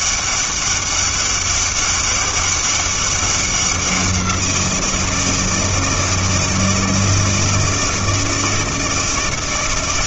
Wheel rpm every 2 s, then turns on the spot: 200, 200, 170, 160, 160.
none